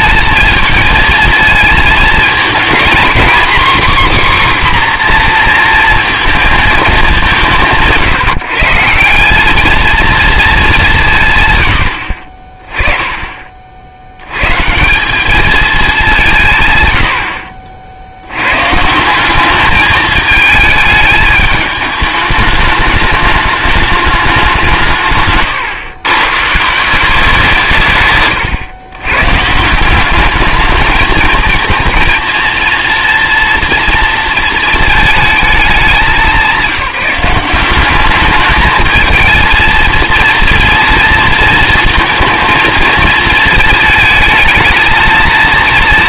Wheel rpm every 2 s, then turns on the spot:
230, 230, 260, 210, 150, 200, 30, 130, 130, 130, 210, 210, 180, 150, 120, 210, 230, 220, 180, 210, 230, 230, 220.
none